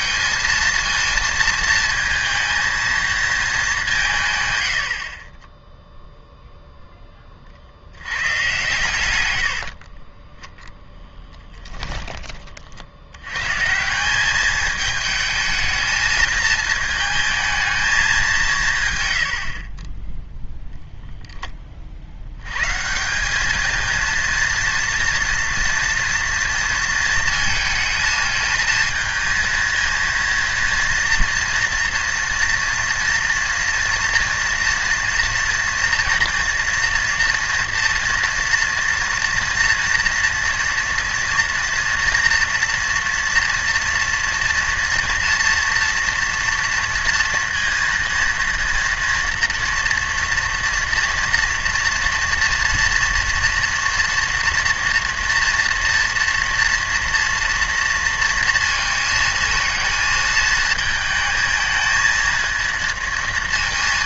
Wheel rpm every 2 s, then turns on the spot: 230, 230, 90, 0, 120, 10, 50, 210, 220, 160, 0, 130, 230, 230, 220, 230, 230, 230, 230, 230, 230, 230, 230, 230, 230, 230, 240, 240, 230, 230, 220, 220.
none